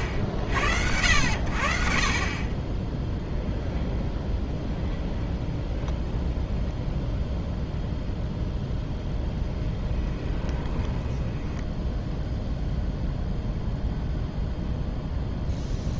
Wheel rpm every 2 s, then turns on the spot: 70, 30, 0, 10, 0, 20, 0, 0.
10-12